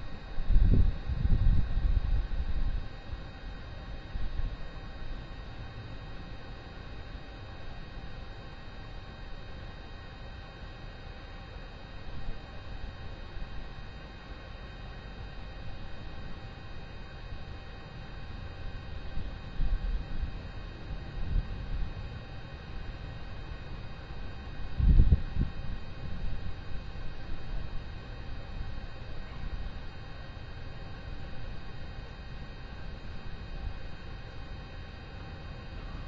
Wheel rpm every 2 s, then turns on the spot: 0, 0, 0, 0, 0, 0, 0, 0, 0, 0, 0, 0, 0, 0, 0, 0, 0, 0.
none